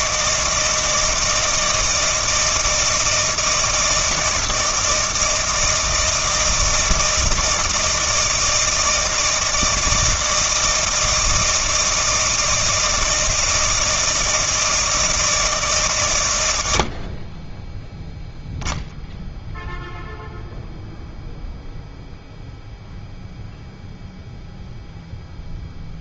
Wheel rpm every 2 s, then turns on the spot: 160, 160, 160, 160, 160, 160, 160, 160, 60, 0, 0, 0, 0.
none